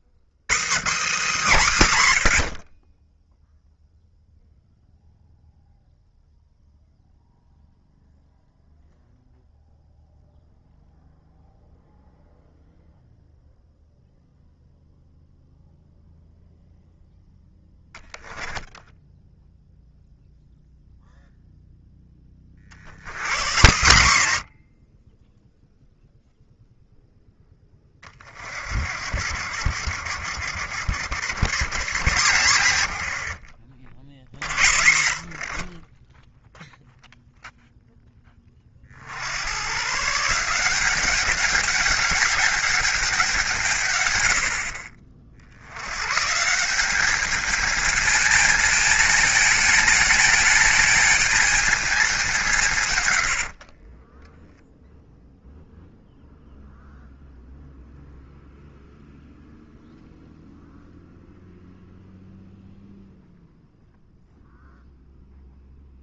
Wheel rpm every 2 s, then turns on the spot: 70, 50, 0, 0, 0, 0, 0, 0, 0, 10, 0, 70, 70, 0, 60, 90, 110, 60, 0, 40, 180, 200, 60, 180, 220, 220, 170, 0, 0, 0, 0, 0, 0.
18-20 28-34